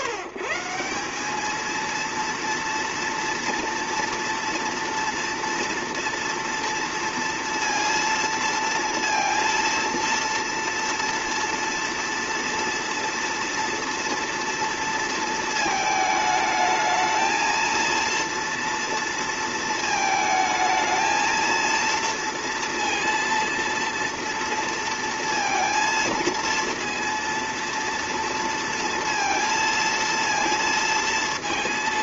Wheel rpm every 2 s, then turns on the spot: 150, 230, 230, 230, 230, 230, 230, 230, 220, 230, 220, 230, 230, 230, 230, 230.
none